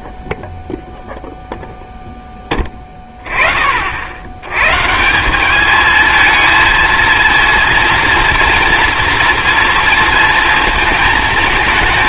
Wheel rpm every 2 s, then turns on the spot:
0, 10, 110, 230, 230, 220.
none